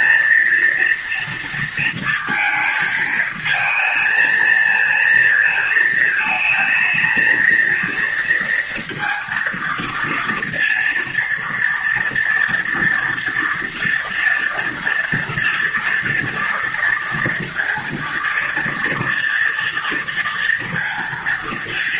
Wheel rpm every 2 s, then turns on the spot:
230, 220, 220, 220, 230, 230, 230, 230, 230, 230, 230.
none